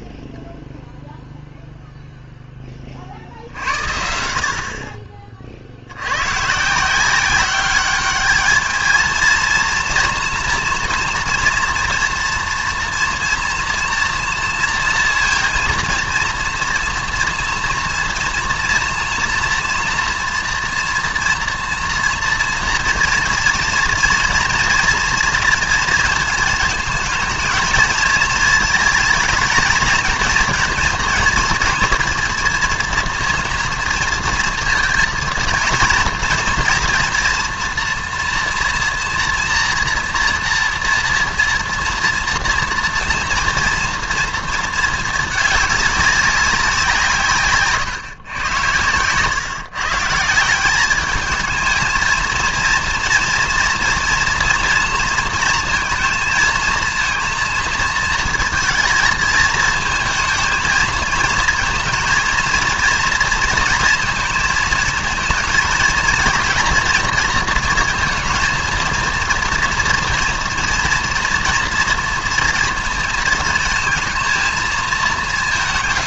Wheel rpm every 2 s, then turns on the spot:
0, 20, 50, 150, 220, 240, 230, 230, 240, 230, 230, 230, 230, 220, 220, 230, 230, 230, 240, 230, 240, 230, 220, 180, 110, 190, 230, 230, 220, 230, 230, 230, 230, 230, 220, 230, 230, 220.
none